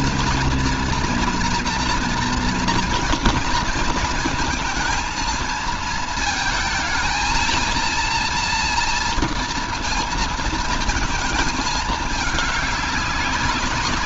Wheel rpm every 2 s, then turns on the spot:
230, 230, 230, 220, 230, 230, 210.
none